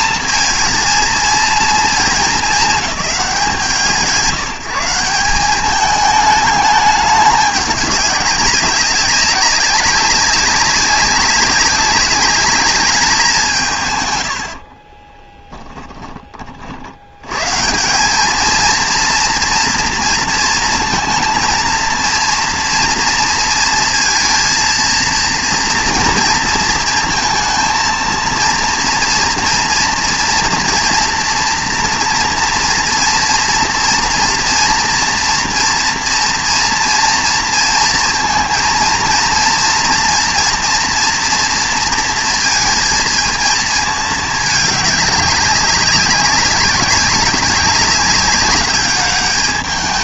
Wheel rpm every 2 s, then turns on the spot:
230, 220, 170, 210, 200, 190, 210, 50, 40, 230, 220, 230, 230, 230, 230, 240, 240, 230, 230, 230, 230, 230, 210, 200, 200.
14-16